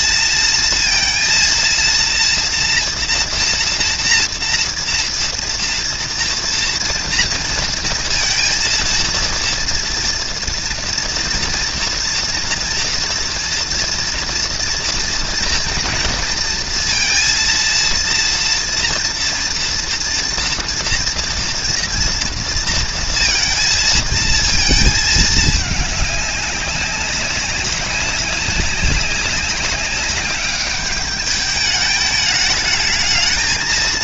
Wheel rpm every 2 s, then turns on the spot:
230, 230, 230, 230, 230, 230, 230, 230, 230, 230, 240, 230, 220, 200, 190, 200, 210.
none